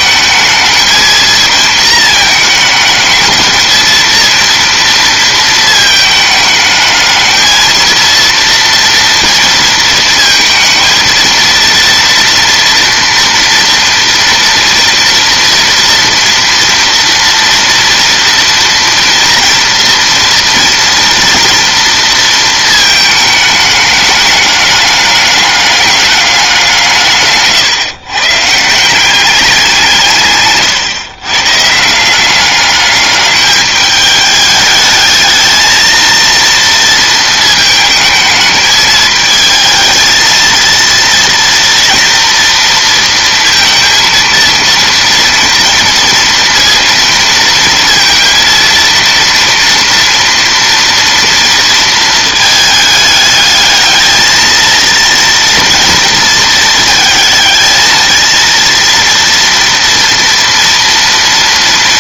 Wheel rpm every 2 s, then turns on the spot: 220, 220, 230, 220, 230, 230, 230, 230, 230, 230, 230, 220, 210, 190, 160, 140, 200, 210, 230, 210, 230, 230, 230, 230, 230, 230, 220, 230, 230, 230, 230.
30-32